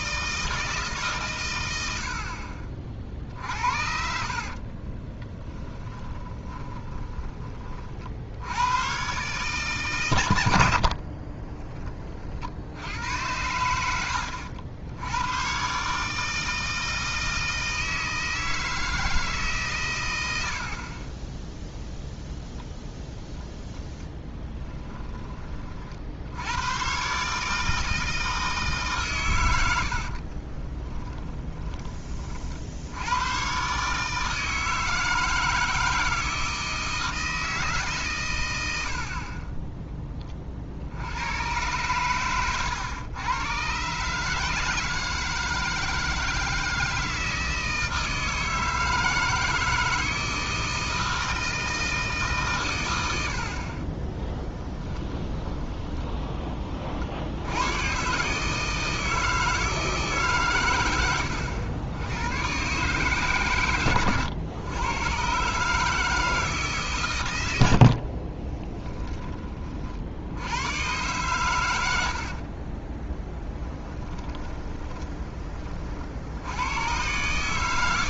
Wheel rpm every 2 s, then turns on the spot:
150, 40, 40, 20, 110, 60, 80, 90, 160, 160, 50, 0, 10, 110, 160, 60, 30, 150, 160, 130, 10, 110, 130, 160, 160, 160, 150, 30, 10, 130, 150, 100, 110, 160, 50, 50, 80, 10, 60.
4-8 10-12 30-32 54-56 68-70 74-76